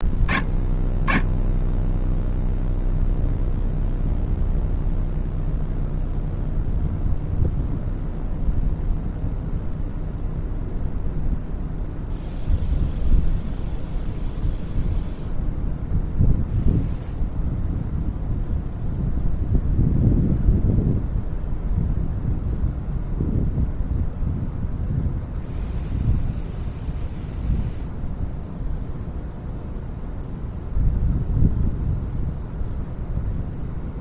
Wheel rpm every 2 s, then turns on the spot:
0, 0, 0, 0, 0, 30, 10, 0, 0, 0, 0, 0, 0, 0, 0, 0, 0.
none